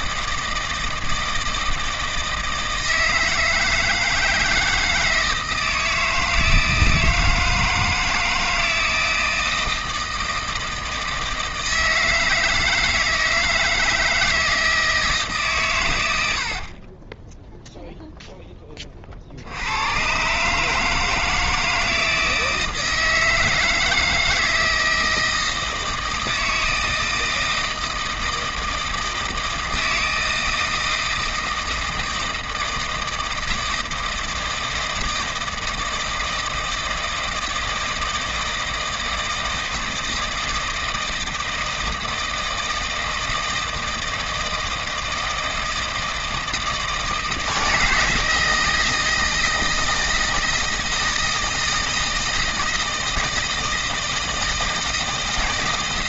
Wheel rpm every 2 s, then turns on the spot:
160, 160, 160, 160, 160, 160, 160, 160, 50, 20, 150, 160, 160, 160, 160, 160, 160, 160, 160, 160, 160, 160, 160, 160, 160, 160, 160, 160.
16-18